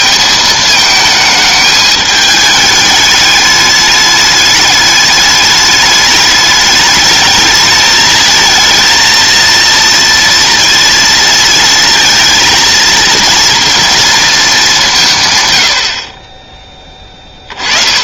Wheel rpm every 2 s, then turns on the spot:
220, 210, 210, 210, 220, 230, 230, 190, 10.
none